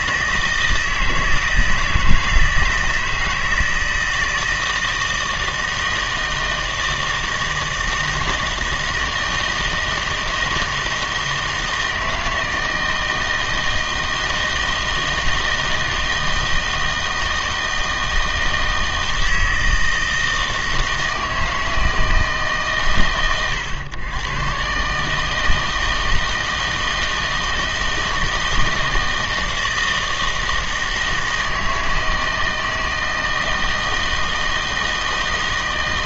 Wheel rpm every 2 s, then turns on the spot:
160, 160, 160, 160, 160, 160, 160, 160, 160, 160, 160, 140, 130, 160, 160, 160, 160, 160.
none